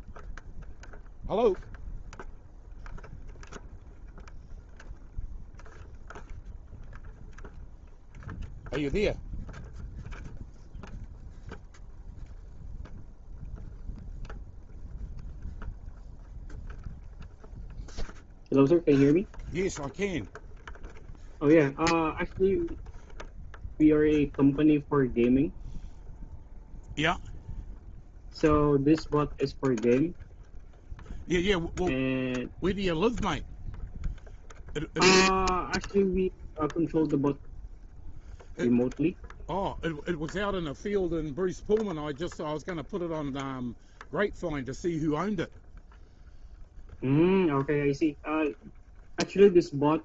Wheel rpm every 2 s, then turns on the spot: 0, 0, 0, 0, 0, 0, 0, 0, 0, 0, 0, 0, 0, 0, 0, 0, 0, 0, 0, 0, 0, 0, 0, 0, 0.
none